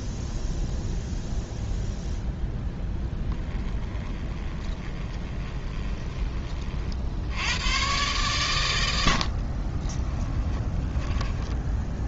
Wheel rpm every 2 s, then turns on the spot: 0, 0, 20, 60, 90, 20.
4-6 10-12